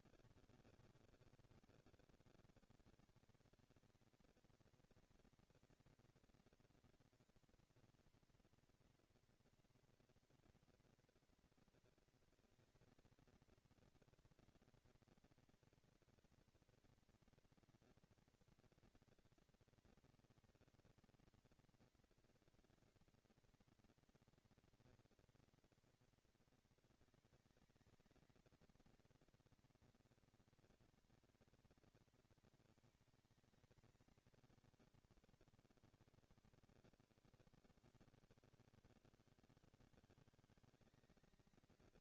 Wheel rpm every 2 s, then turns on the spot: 160, 180, 230, 230, 240, 230, 230, 230, 230, 230, 230, 230, 230, 220, 230, 220, 210, 140, 100, 160, 190.
none